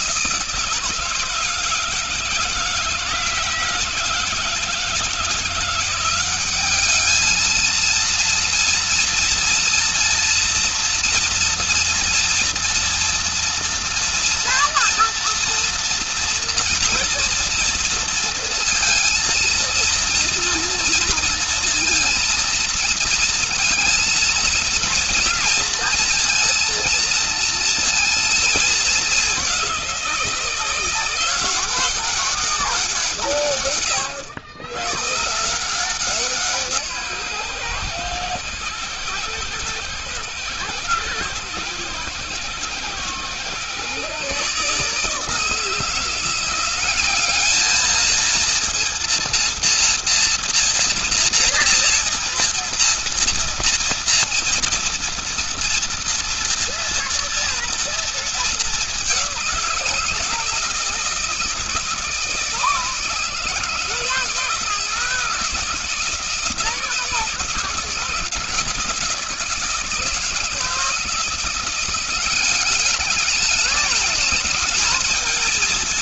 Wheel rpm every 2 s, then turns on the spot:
160, 160, 170, 210, 230, 230, 230, 230, 230, 230, 230, 230, 230, 230, 220, 170, 180, 120, 160, 110, 110, 120, 150, 190, 230, 230, 230, 230, 230, 210, 170, 160, 160, 160, 170, 160, 200, 220.
none